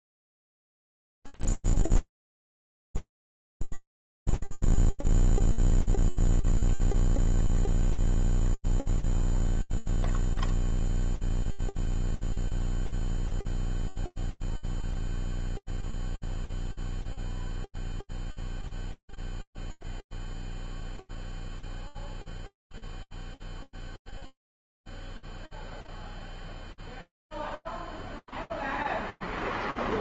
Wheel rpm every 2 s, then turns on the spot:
0, 0, 0, 0, 0, 0, 0, 0, 0, 0, 0, 0, 0, 0, 0.
none